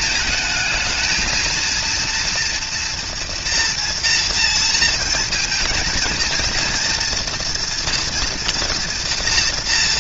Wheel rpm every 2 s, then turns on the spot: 220, 230, 230, 240, 230.
none